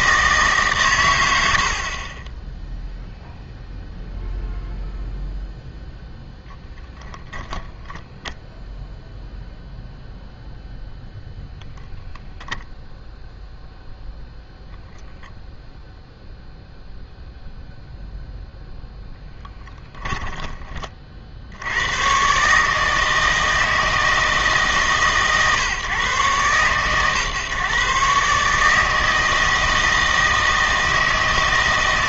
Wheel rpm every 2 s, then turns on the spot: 140, 10, 0, 0, 0, 0, 0, 0, 0, 0, 20, 150, 150, 130, 150, 160.
2-4